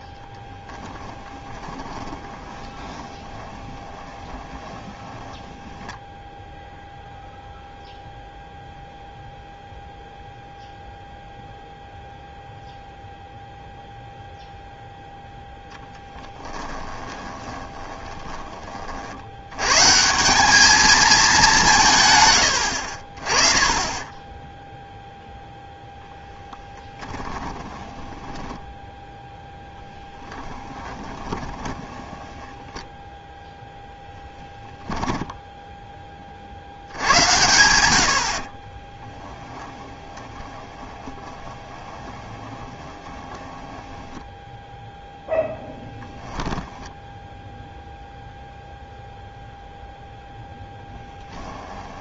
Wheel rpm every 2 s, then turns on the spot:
20, 20, 20, 0, 0, 0, 0, 0, 20, 50, 210, 50, 0, 20, 10, 20, 10, 20, 80, 30, 20, 20, 0, 0, 0, 10.
0-6 16-18 26-36 38-44 50-52